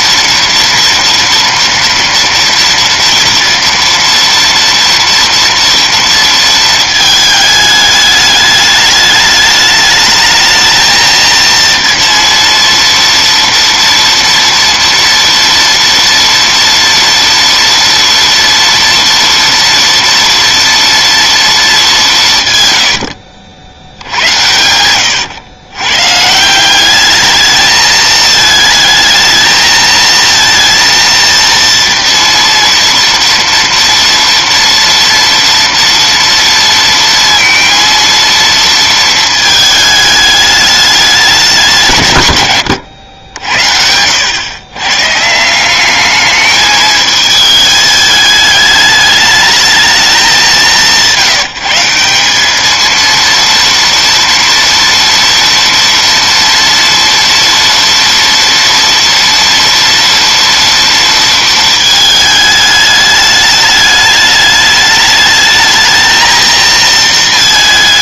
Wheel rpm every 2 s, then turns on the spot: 230, 230, 230, 220, 210, 220, 230, 230, 240, 230, 230, 110, 100, 200, 220, 230, 230, 230, 230, 230, 210, 110, 130, 220, 210, 140, 220, 230, 230, 230, 230, 210, 210, 230.
24-26